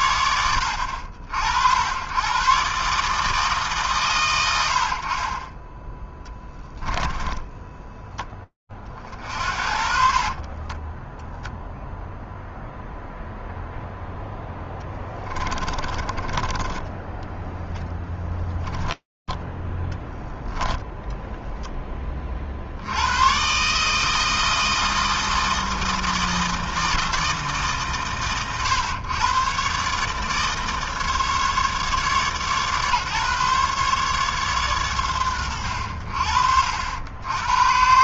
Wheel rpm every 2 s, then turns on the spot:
100, 80, 140, 10, 20, 60, 0, 0, 20, 0, 10, 20, 160, 160, 120, 140, 150, 140, 70.
16-18 20-22